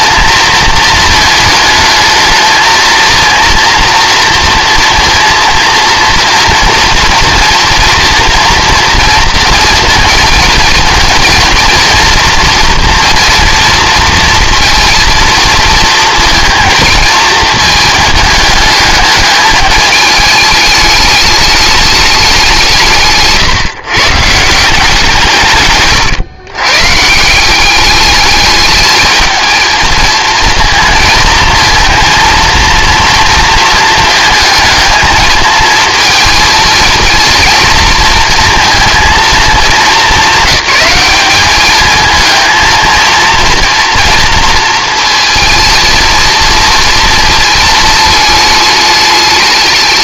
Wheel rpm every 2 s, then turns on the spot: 220, 230, 230, 230, 230, 240, 230, 230, 230, 210, 210, 160, 170, 140, 210, 230, 230, 220, 230, 230, 210, 230, 230, 230, 210.
none